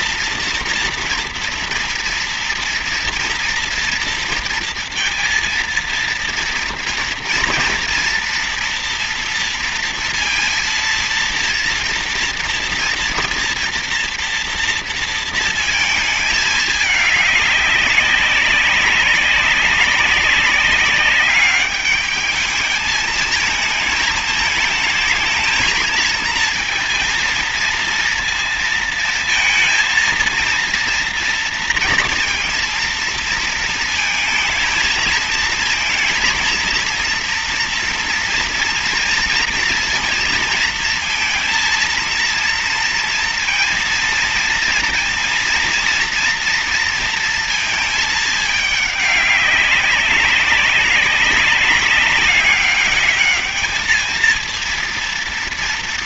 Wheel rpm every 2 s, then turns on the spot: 240, 230, 230, 230, 230, 230, 230, 230, 220, 190, 200, 210, 220, 230, 230, 230, 230, 220, 230, 230, 230, 230, 230, 240, 210, 190, 200, 230.
none